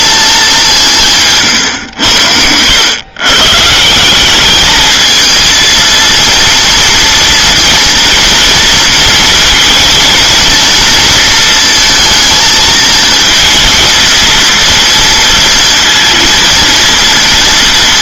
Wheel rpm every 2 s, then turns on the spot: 190, 90, 210, 230, 230, 230, 220, 230, 230.
none